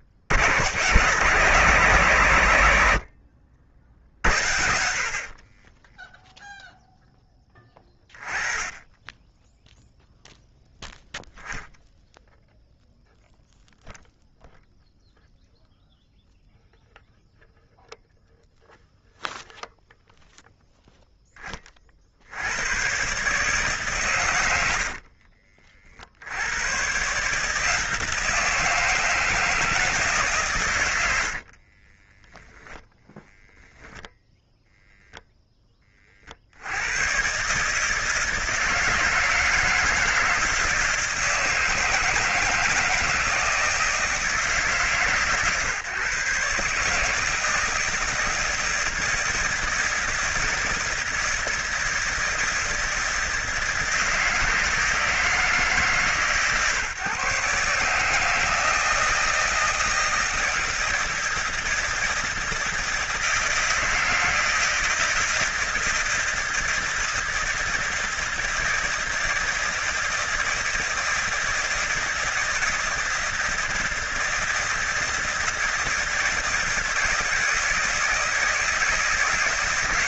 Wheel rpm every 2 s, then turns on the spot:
50, 110, 90, 0, 20, 0, 0, 0, 0, 0, 0, 90, 90, 110, 160, 130, 0, 0, 90, 160, 160, 160, 150, 150, 160, 160, 160, 160, 140, 160, 160, 160, 160, 160, 160, 160, 160, 160, 160, 160.
none